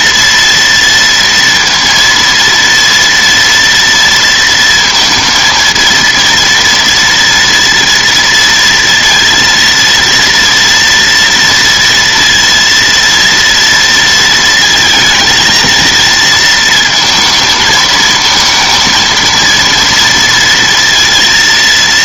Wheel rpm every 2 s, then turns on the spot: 230, 230, 230, 230, 230, 230, 230, 230, 230, 220, 230.
none